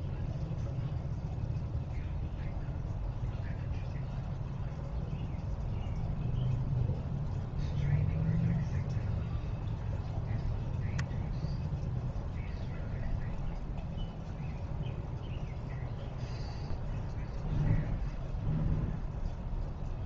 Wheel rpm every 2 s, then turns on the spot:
0, 0, 0, 0, 0, 0, 0, 0, 0, 0.
none